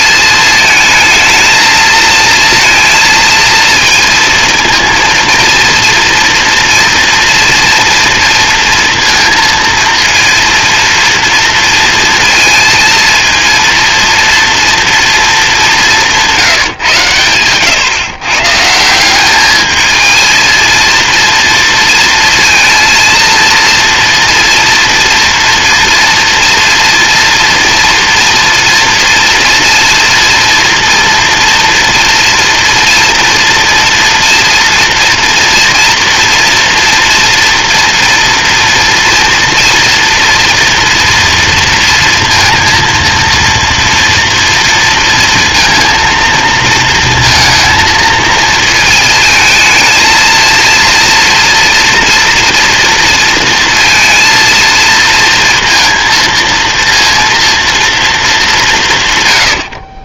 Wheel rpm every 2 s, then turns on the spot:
230, 230, 230, 230, 230, 230, 230, 210, 120, 210, 230, 230, 240, 240, 230, 230, 230, 230, 230, 240, 230, 230, 230, 230, 220, 230, 230, 230, 230, 120.
none